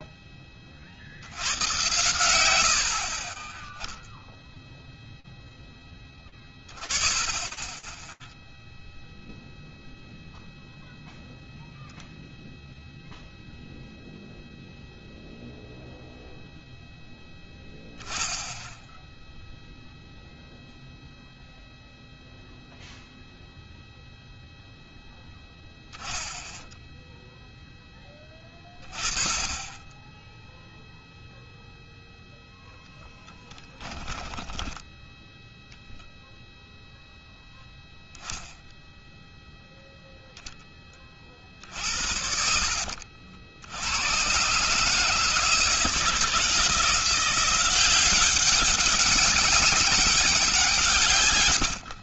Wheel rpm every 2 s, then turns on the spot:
10, 100, 0, 10, 0, 0, 0, 0, 0, 0, 0, 0, 0, 0, 20, 10, 0, 10, 0, 0, 10, 60, 110, 160, 190, 190.
34-36